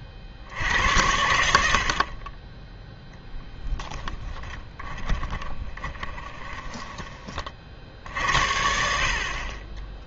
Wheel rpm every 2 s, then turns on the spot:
80, 10, 10, 20, 60.
4-8